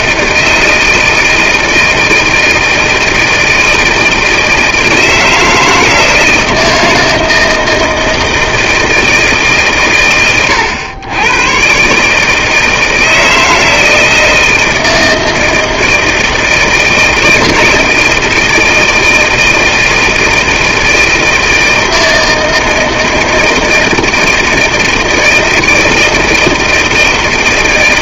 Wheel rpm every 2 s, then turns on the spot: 160, 160, 160, 160, 160, 90, 150, 160, 160, 160, 160, 160, 160, 160.
none